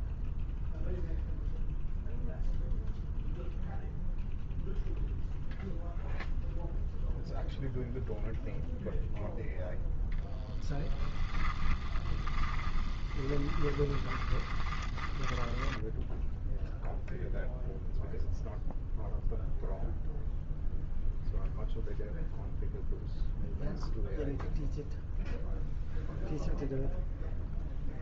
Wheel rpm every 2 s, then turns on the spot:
0, 0, 0, 0, 0, 10, 20, 20, 0, 0, 0, 0, 0, 0.
10-16